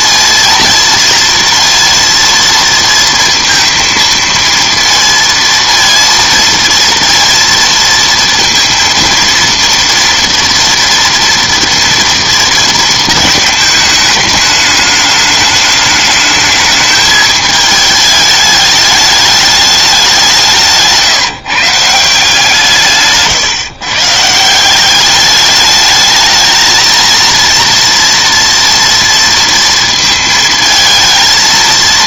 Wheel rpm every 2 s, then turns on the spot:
230, 230, 230, 230, 230, 230, 230, 210, 210, 210, 160, 160, 180, 230, 230, 220.
20-22